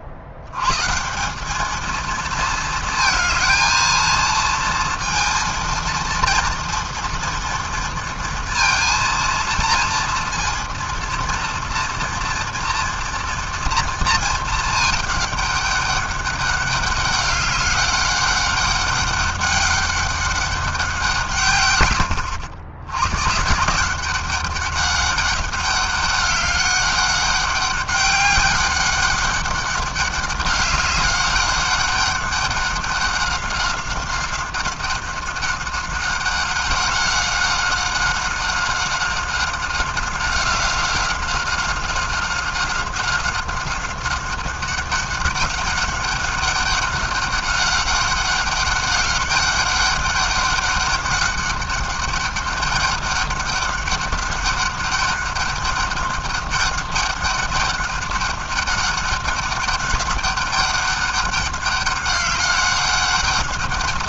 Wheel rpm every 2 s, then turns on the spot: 130, 220, 230, 230, 230, 230, 230, 220, 200, 200, 190, 80, 200, 200, 200, 200, 200, 190, 190, 190, 190, 190, 190, 200, 200, 200, 200, 200, 200, 200, 200, 200.
none